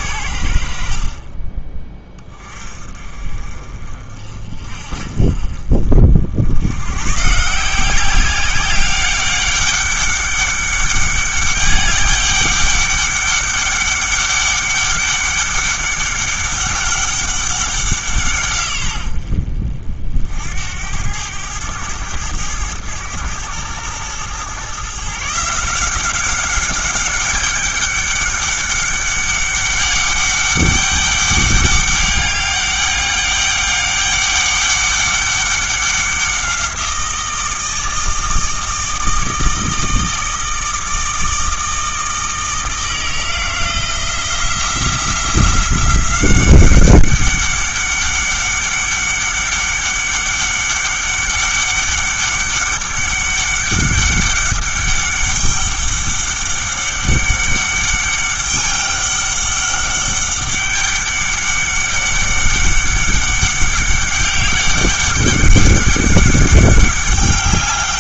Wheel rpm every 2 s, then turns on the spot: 70, 30, 40, 90, 190, 200, 200, 200, 200, 120, 80, 110, 130, 200, 200, 200, 200, 200, 180, 160, 160, 160, 170, 190, 200, 200, 200, 200, 200, 200, 200, 200, 200, 200.
none